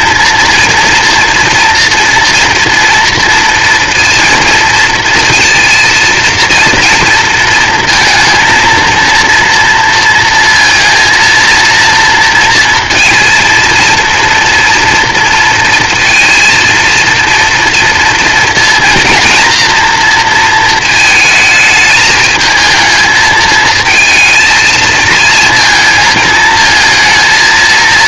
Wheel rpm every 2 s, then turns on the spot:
230, 230, 230, 230, 230, 230, 230, 230, 230, 230, 220, 220, 220, 230.
none